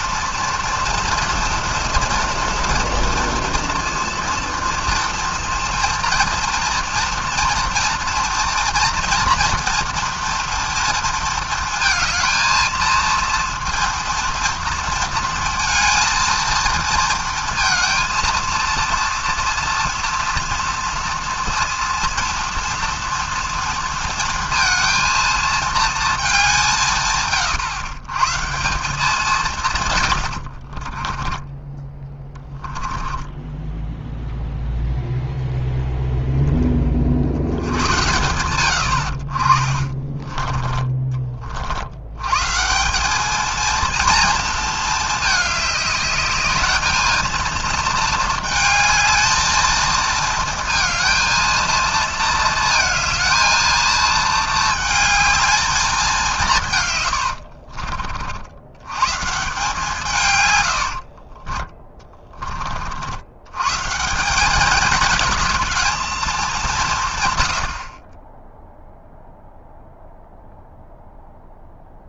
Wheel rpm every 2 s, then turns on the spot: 230, 230, 230, 230, 230, 230, 230, 230, 230, 230, 230, 230, 230, 180, 160, 40, 10, 0, 30, 100, 20, 170, 230, 210, 220, 220, 230, 220, 150, 100, 90, 40, 210, 190, 0, 0.
30-34 40-42 60-62